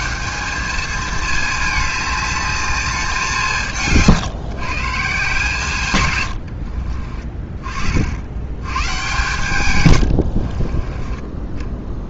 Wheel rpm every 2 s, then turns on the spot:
210, 210, 140, 80, 100, 50.
6-8 10-12